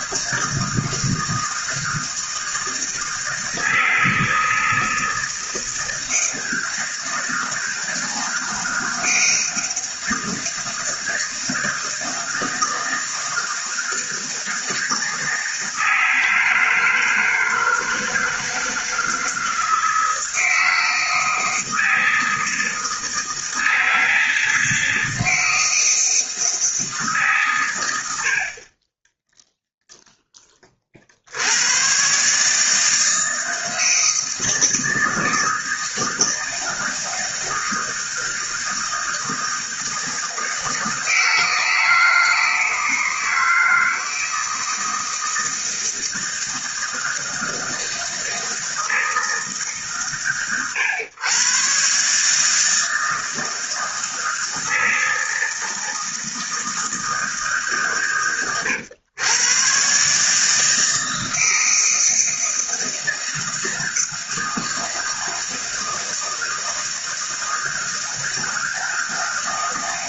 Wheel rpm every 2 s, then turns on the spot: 160, 160, 160, 160, 160, 160, 160, 160, 160, 160, 160, 160, 160, 160, 50, 20, 150, 160, 160, 160, 160, 160, 160, 160, 160, 110, 150, 160, 160, 120, 150, 160, 160, 160, 160.
none